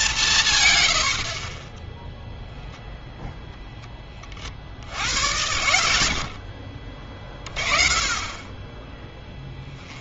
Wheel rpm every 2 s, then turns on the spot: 120, 0, 60, 50, 20.
6-8